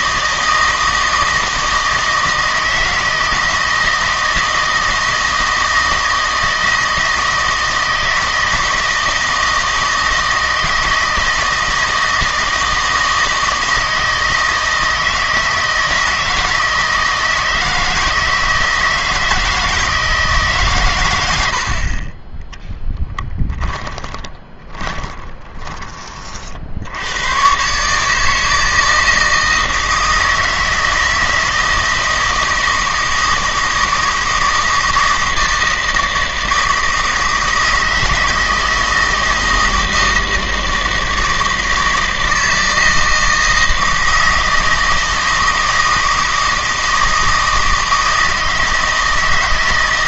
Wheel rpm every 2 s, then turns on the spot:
160, 160, 160, 160, 160, 160, 160, 160, 160, 160, 140, 10, 20, 70, 160, 160, 160, 160, 160, 160, 160, 160, 160, 160, 160.
22-26